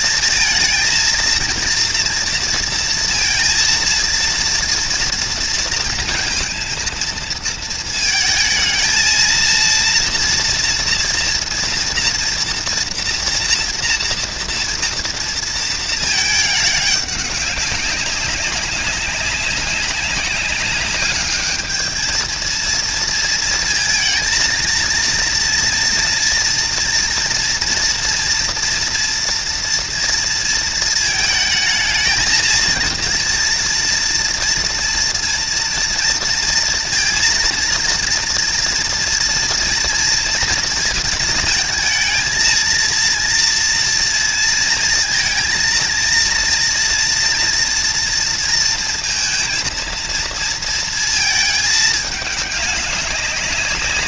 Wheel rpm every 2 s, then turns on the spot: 220, 230, 230, 230, 230, 230, 230, 230, 210, 200, 200, 230, 230, 230, 230, 220, 230, 230, 230, 230, 230, 230, 230, 230, 230, 230, 200.
none